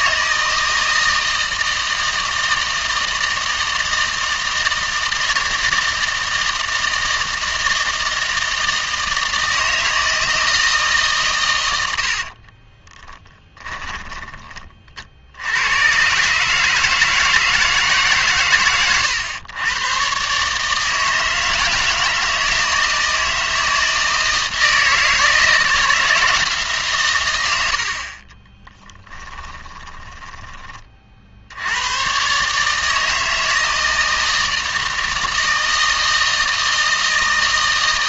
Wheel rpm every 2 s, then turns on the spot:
160, 160, 160, 160, 160, 160, 30, 30, 150, 130, 150, 160, 160, 150, 20, 20, 150, 160, 160.
12-14 28-30